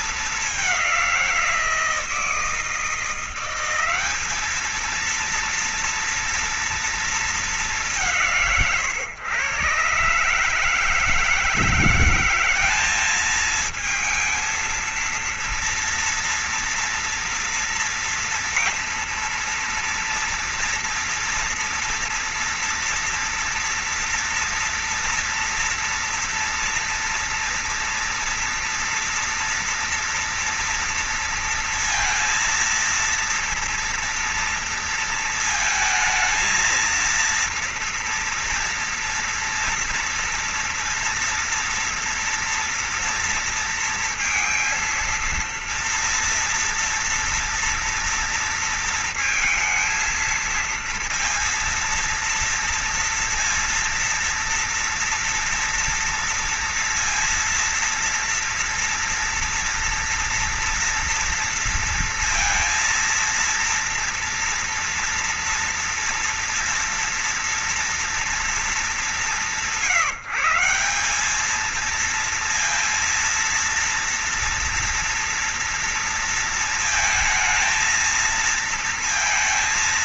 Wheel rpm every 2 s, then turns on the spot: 220, 170, 200, 230, 180, 140, 180, 220, 240, 230, 230, 240, 230, 230, 230, 230, 230, 230, 230, 230, 230, 240, 230, 230, 230, 230, 230, 230, 230, 230, 230, 230, 230, 230, 230, 170, 230, 230, 230, 230.
none